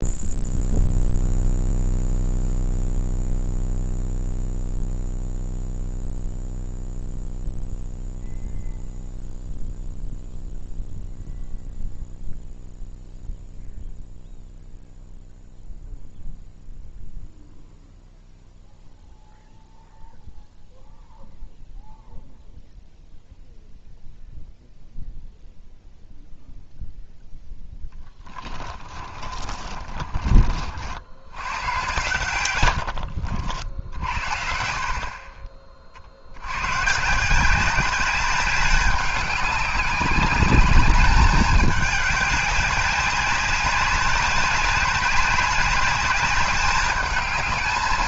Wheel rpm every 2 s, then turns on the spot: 0, 0, 0, 0, 0, 0, 0, 0, 0, 0, 0, 0, 0, 0, 20, 50, 100, 60, 130, 200, 200, 200, 200, 210.
28-30 34-36